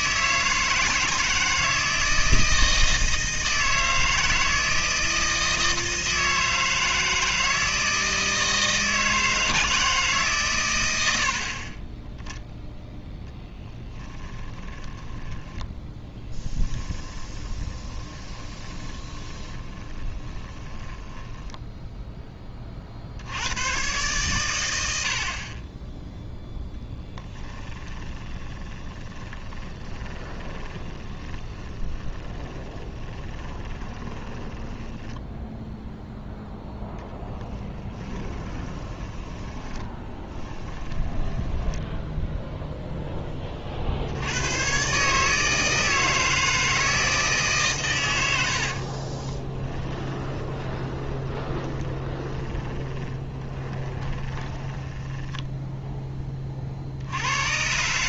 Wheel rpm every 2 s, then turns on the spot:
160, 160, 160, 160, 160, 100, 0, 10, 10, 20, 10, 50, 90, 10, 20, 30, 20, 10, 0, 10, 10, 0, 120, 160, 50, 20, 20, 20, 50.
14-22 26-36 38-42 48-56